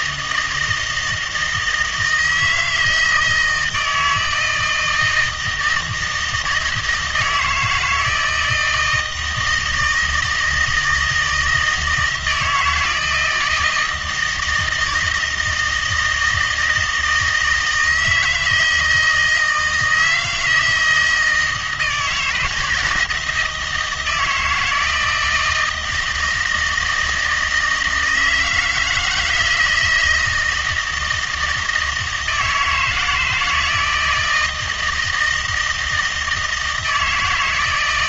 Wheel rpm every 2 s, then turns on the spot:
160, 160, 160, 160, 160, 160, 160, 160, 160, 160, 160, 160, 170, 160, 160, 160, 160, 160, 160.
none